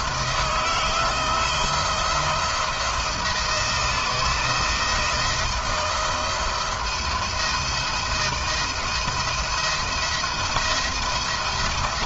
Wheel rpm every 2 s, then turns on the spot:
170, 160, 170, 160, 160, 170.
none